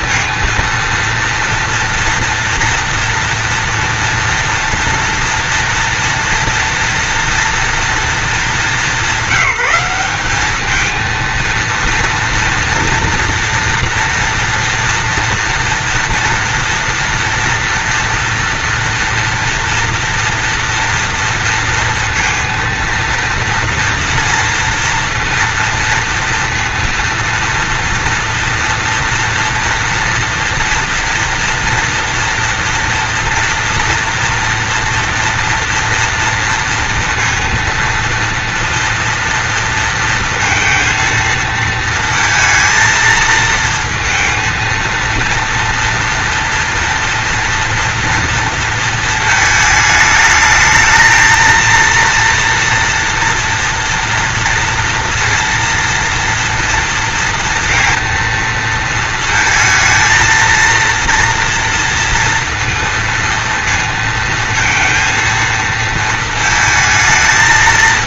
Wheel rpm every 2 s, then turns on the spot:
230, 230, 230, 230, 210, 210, 230, 230, 230, 230, 230, 230, 230, 230, 230, 230, 230, 230, 230, 230, 230, 220, 230, 230, 230, 220, 230, 230, 230, 230, 230, 230, 230, 220.
none